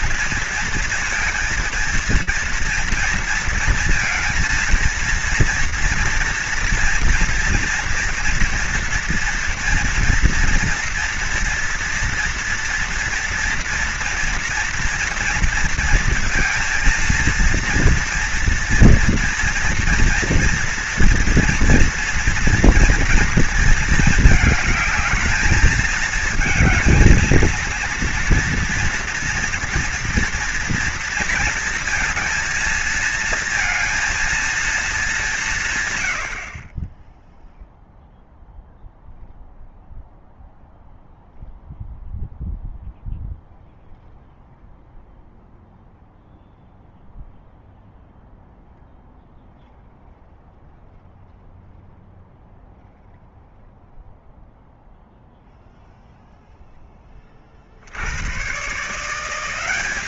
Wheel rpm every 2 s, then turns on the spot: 230, 230, 230, 230, 230, 230, 230, 230, 230, 230, 240, 240, 210, 220, 230, 230, 220, 220, 30, 0, 0, 0, 0, 0, 0, 0, 0, 0, 10, 150.
none